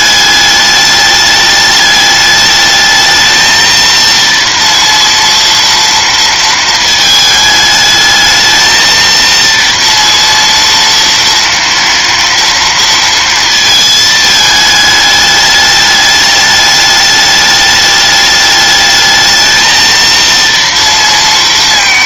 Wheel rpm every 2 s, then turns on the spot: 210, 210, 230, 230, 220, 230, 230, 220, 210, 210, 230.
none